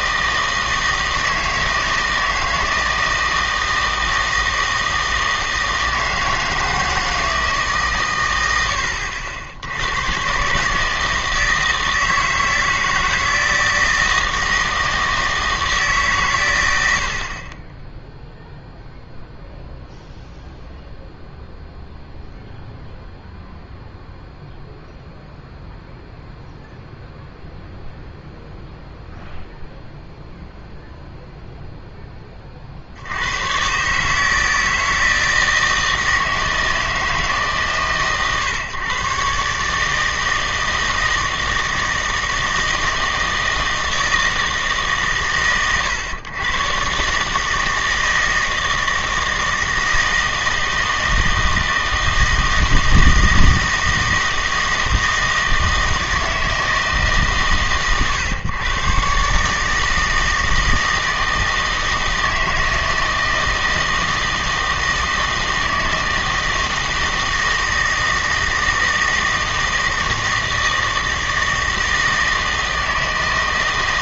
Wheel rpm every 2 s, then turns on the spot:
160, 160, 160, 160, 90, 140, 160, 160, 110, 0, 0, 0, 0, 0, 0, 0, 60, 160, 160, 130, 160, 160, 160, 130, 160, 160, 160, 160, 160, 120, 160, 160, 160, 160, 160, 160, 160.
none